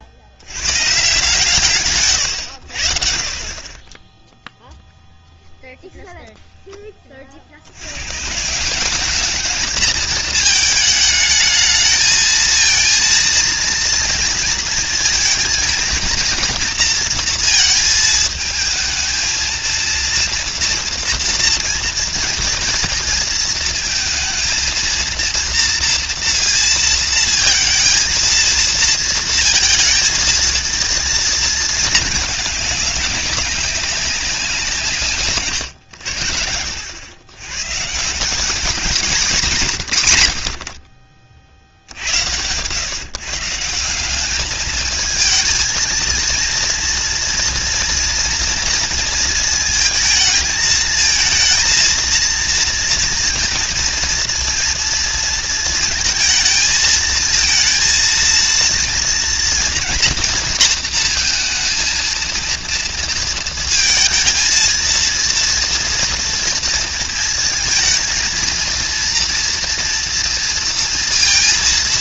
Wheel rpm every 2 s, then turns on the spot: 120, 60, 0, 10, 170, 220, 230, 220, 230, 220, 240, 230, 230, 230, 230, 230, 200, 160, 80, 210, 60, 110, 220, 230, 230, 220, 230, 230, 220, 230, 230, 230, 230, 230, 230, 230.
none